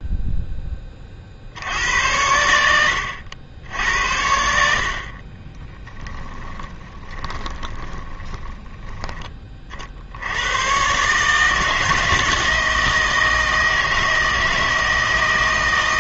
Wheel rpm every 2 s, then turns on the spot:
20, 90, 70, 30, 10, 110, 160, 160.
6-10